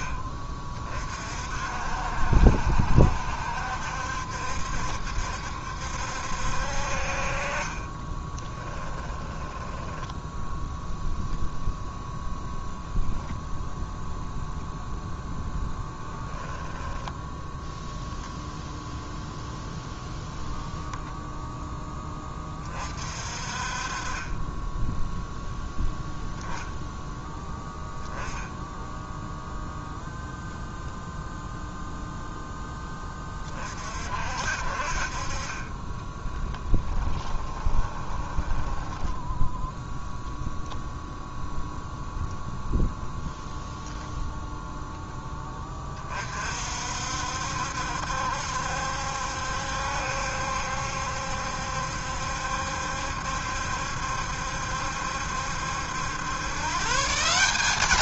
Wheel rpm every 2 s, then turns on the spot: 30, 60, 70, 50, 10, 0, 0, 0, 0, 0, 0, 40, 10, 0, 0, 0, 20, 50, 10, 10, 0, 0, 10, 60, 70, 70, 70, 70, 150.
8-10 36-40